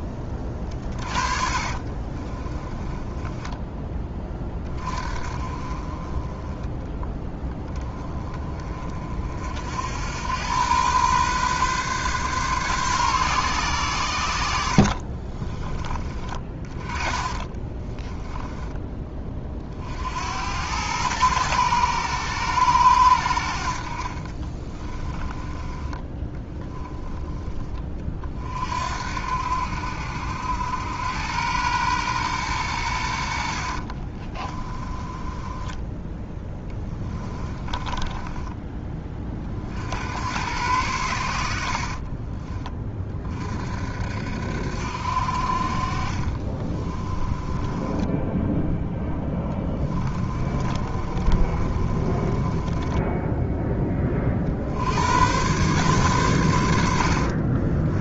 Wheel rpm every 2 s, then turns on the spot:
30, 20, 30, 10, 30, 110, 130, 60, 30, 10, 90, 100, 20, 10, 60, 90, 100, 20, 20, 20, 100, 30, 60, 20, 0, 30, 20, 70, 80.
0-4 14-18 24-26 34-38 46-48 50-54 56-58